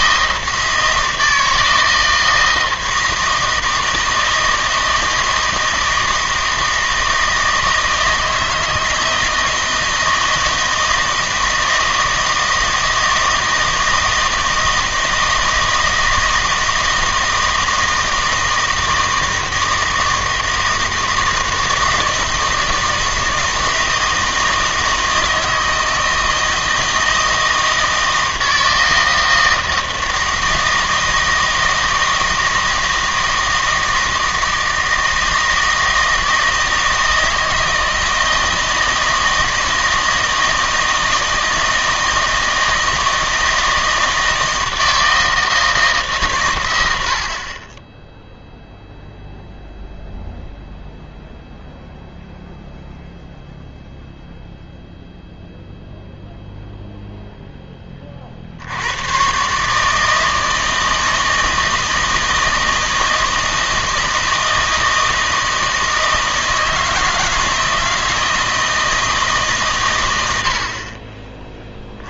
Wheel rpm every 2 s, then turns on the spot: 160, 160, 160, 160, 160, 160, 160, 160, 160, 160, 160, 160, 160, 160, 160, 160, 160, 160, 160, 160, 160, 160, 160, 90, 0, 0, 0, 0, 0, 80, 160, 160, 160, 160, 160, 40.
none